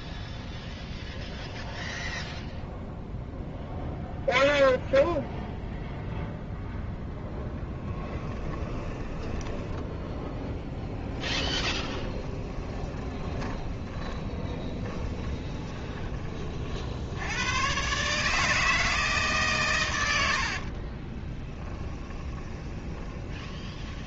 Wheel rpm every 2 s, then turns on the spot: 0, 0, 0, 0, 10, 10, 20, 20, 60, 160, 30, 20.
8-16 20-24